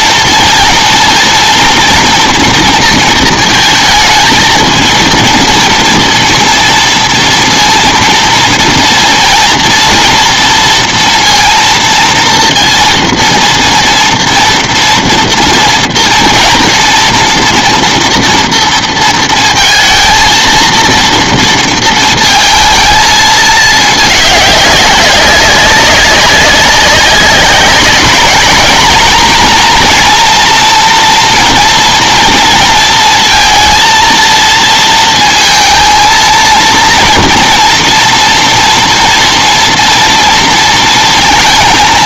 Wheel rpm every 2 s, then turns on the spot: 230, 230, 230, 230, 230, 230, 240, 230, 230, 230, 230, 220, 190, 190, 220, 230, 230, 230, 230, 240, 230.
none